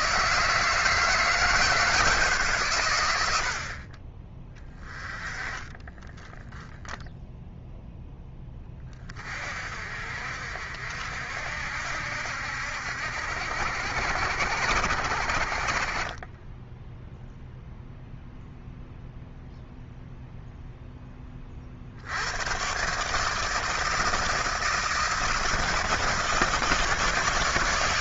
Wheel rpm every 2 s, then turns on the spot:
160, 130, 20, 10, 30, 60, 70, 80, 10, 0, 0, 120, 160, 160.
4-6 16-18